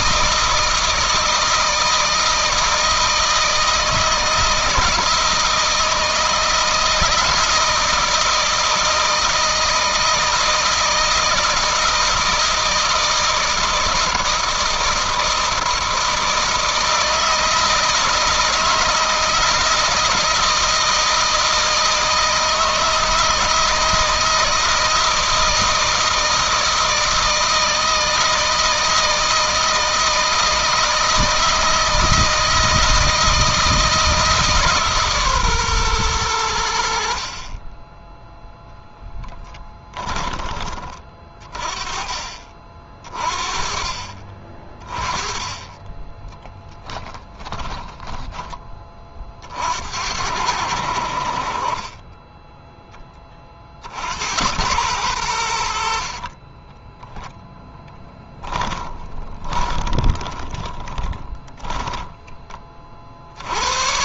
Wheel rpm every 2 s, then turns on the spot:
160, 160, 160, 160, 160, 160, 160, 160, 160, 160, 160, 160, 160, 160, 160, 160, 160, 150, 70, 0, 30, 50, 20, 10, 30, 70, 20, 110, 10, 20, 10, 50.
46-48 56-62